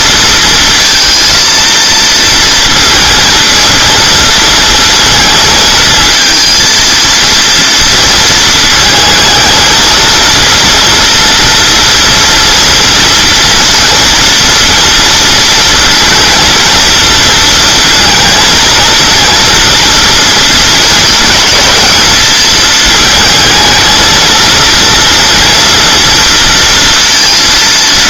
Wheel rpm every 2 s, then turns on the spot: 230, 230, 230, 230, 220, 230, 230, 240, 230, 230, 220, 220, 230, 230.
none